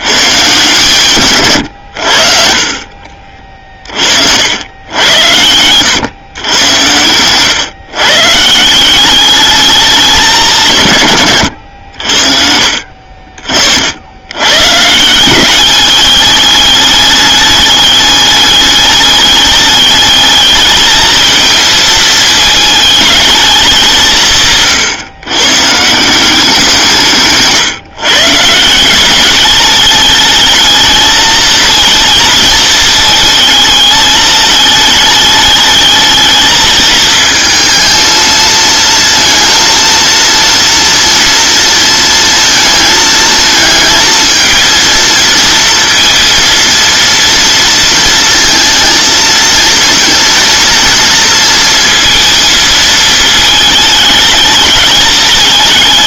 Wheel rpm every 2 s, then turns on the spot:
150, 50, 90, 100, 170, 120, 60, 140, 210, 210, 210, 220, 140, 170, 170, 220, 220, 210, 220, 230, 230, 230, 230, 230, 230, 230, 220, 210.
2-4